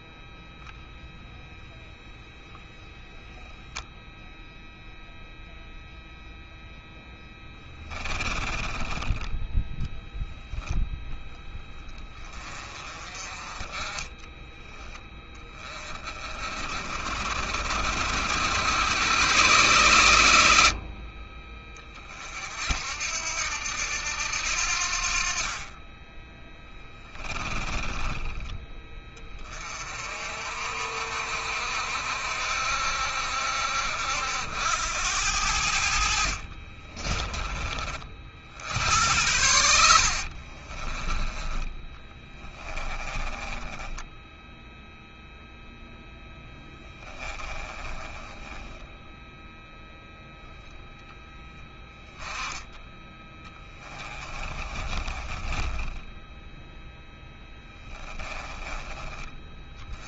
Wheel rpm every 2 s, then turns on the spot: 0, 0, 0, 0, 20, 10, 30, 10, 40, 100, 70, 60, 70, 10, 30, 50, 60, 80, 50, 80, 40, 20, 10, 10, 10, 0, 10, 20, 0, 20.
26-28 36-38 40-44 46-50 54-56